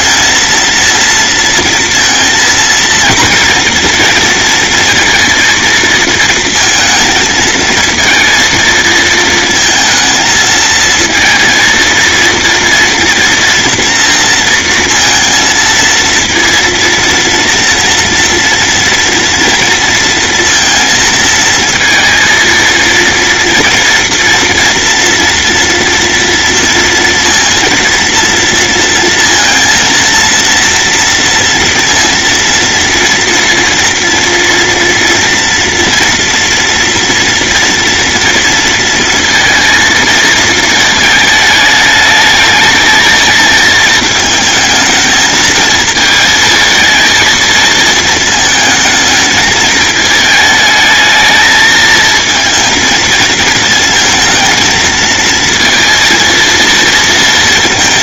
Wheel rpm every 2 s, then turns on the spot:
230, 230, 230, 230, 230, 220, 230, 230, 230, 230, 230, 230, 230, 230, 230, 230, 230, 230, 230, 230, 220, 220, 220, 220, 220, 220, 230, 220, 230.
none